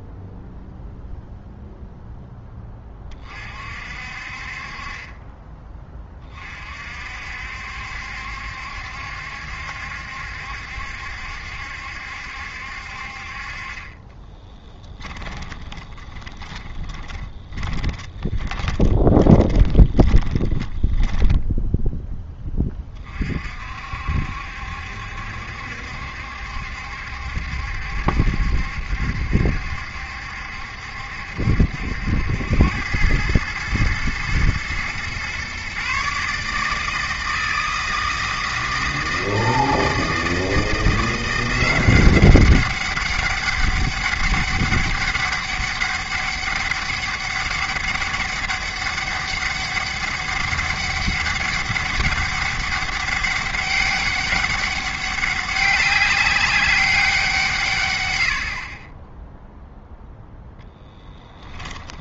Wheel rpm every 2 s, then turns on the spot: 0, 20, 40, 50, 70, 70, 60, 20, 20, 20, 10, 30, 70, 70, 70, 70, 100, 120, 160, 160, 170, 190, 200, 200, 200, 200, 200, 200, 190, 30, 10.
14-22